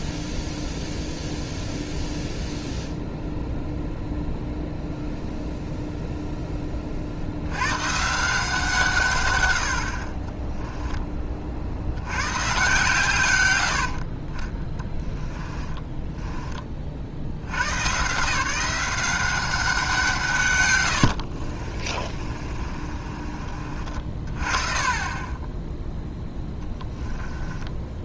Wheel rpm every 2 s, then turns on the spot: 0, 0, 0, 20, 160, 10, 130, 20, 20, 170, 120, 40, 30, 10.
10-12 22-28